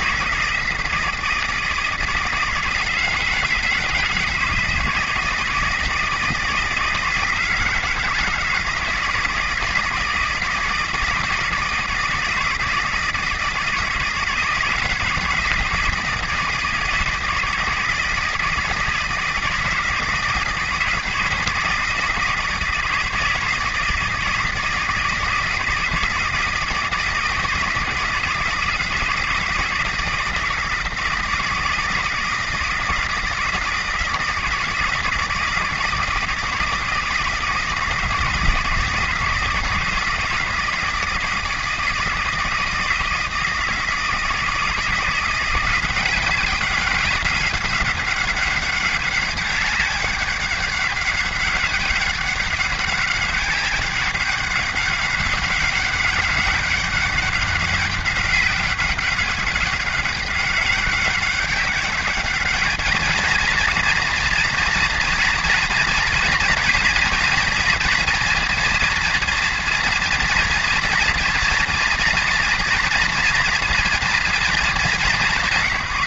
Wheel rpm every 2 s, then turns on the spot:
160, 160, 160, 160, 160, 160, 160, 160, 160, 160, 160, 160, 160, 160, 160, 160, 160, 160, 160, 160, 160, 160, 170, 200, 200, 200, 190, 200, 200, 200, 200, 220, 230, 230, 230, 230, 230, 200.
none